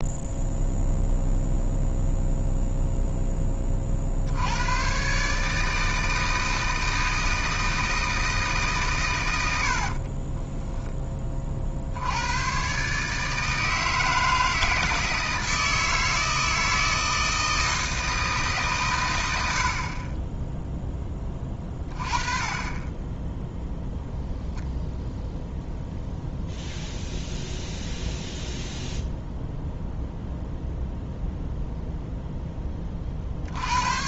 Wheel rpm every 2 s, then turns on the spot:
0, 0, 110, 160, 140, 10, 130, 160, 160, 140, 10, 20, 0, 0, 0, 0, 20.
none